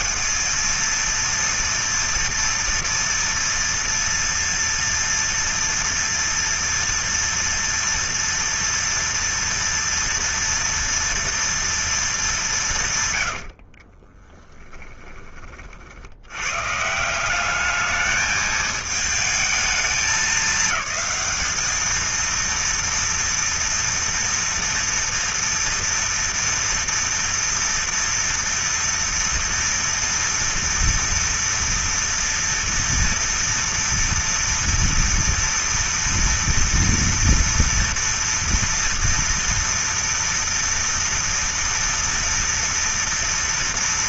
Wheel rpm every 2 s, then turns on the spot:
230, 230, 230, 230, 230, 230, 170, 10, 130, 220, 210, 230, 230, 230, 240, 230, 230, 230, 230, 230, 230, 240.
14-16